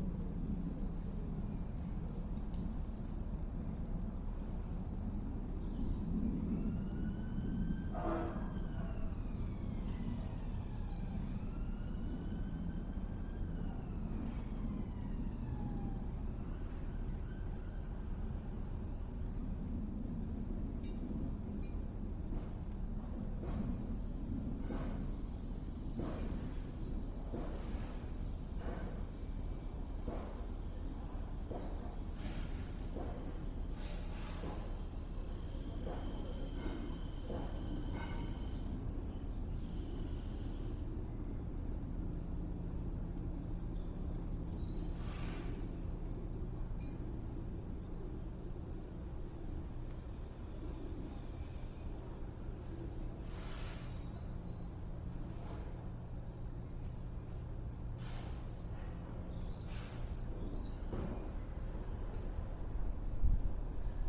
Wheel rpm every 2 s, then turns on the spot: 0, 0, 0, 0, 0, 0, 0, 0, 0, 0, 0, 0, 0, 0, 0, 0, 0, 0, 0, 0, 0, 0, 0, 0, 0, 0, 0, 0, 0, 0, 0, 0.
none